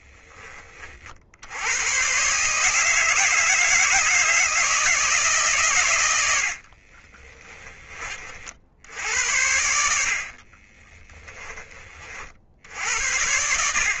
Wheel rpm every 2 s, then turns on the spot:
30, 160, 160, 50, 80, 30, 60.
6-8 10-12